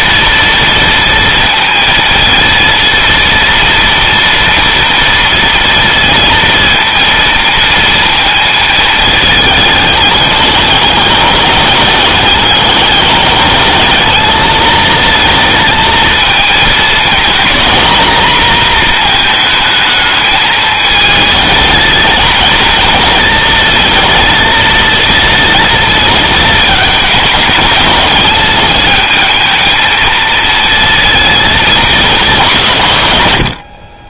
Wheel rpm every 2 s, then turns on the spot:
230, 230, 230, 230, 220, 210, 210, 220, 220, 230, 220, 220, 230, 220, 210, 230, 150.
none